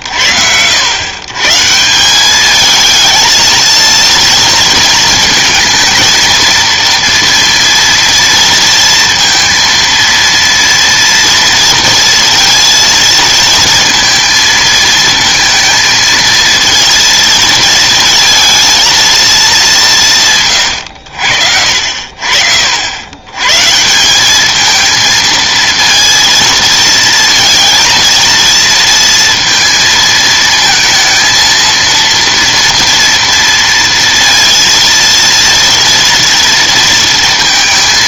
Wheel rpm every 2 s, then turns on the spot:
100, 210, 230, 230, 230, 230, 230, 230, 220, 220, 120, 70, 220, 230, 230, 230, 230, 230, 230.
none